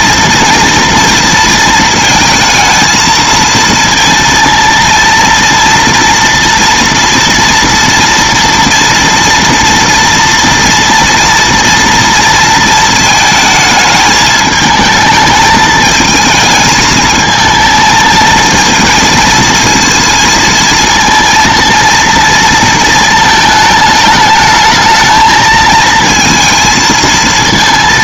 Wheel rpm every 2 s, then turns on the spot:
230, 230, 230, 230, 230, 230, 230, 220, 220, 230, 230, 230, 220, 220.
none